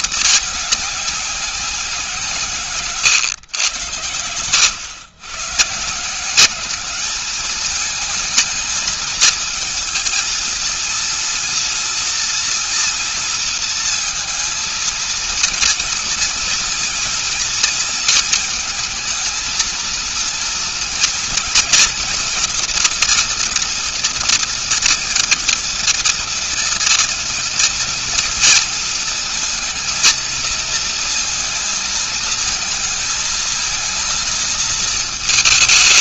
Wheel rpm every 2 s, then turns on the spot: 210, 160, 120, 180, 220, 230, 230, 220, 230, 230, 230, 240, 230, 230, 230, 220, 220, 230.
none